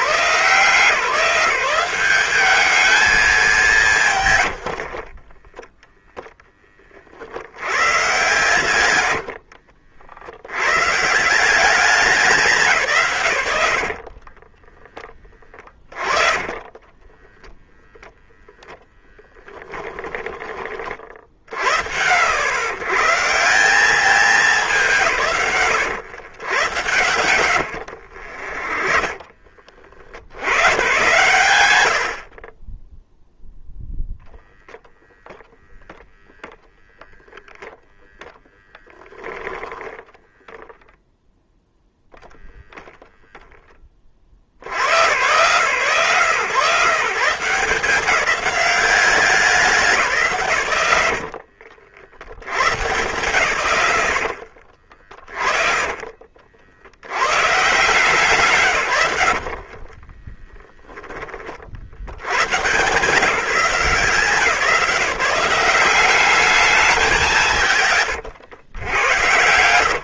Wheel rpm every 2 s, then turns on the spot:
160, 210, 70, 30, 110, 110, 170, 30, 10, 0, 30, 100, 170, 120, 30, 100, 40, 0, 0, 0, 0, 0, 50, 140, 200, 140, 100, 60, 70, 120, 10, 120, 180, 210, 120.
4-6 14-18 26-30 54-56 68-70